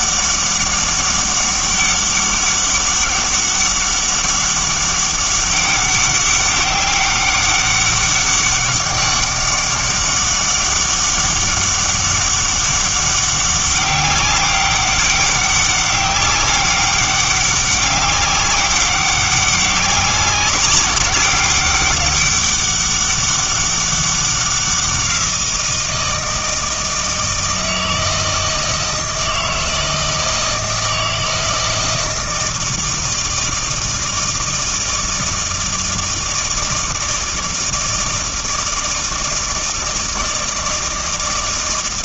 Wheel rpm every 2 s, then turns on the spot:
200, 200, 200, 200, 200, 200, 200, 200, 200, 200, 190, 200, 180, 160, 160, 160, 160, 160, 160, 160, 160.
none